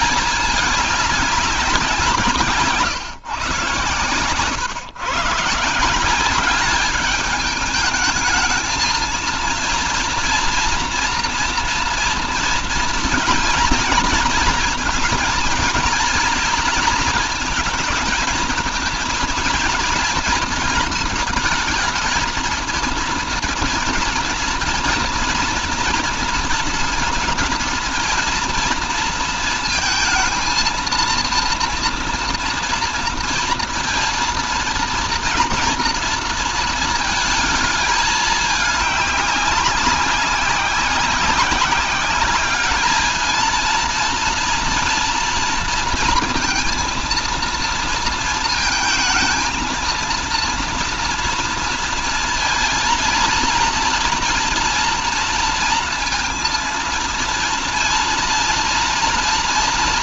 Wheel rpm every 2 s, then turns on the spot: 210, 140, 120, 200, 220, 230, 230, 230, 230, 230, 230, 230, 230, 230, 230, 230, 230, 230, 230, 210, 190, 210, 230, 230, 230, 230, 230, 230, 230, 230.
none